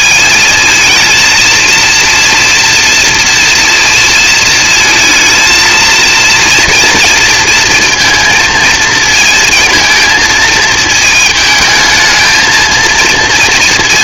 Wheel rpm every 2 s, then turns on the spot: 220, 230, 230, 230, 230, 220, 230.
none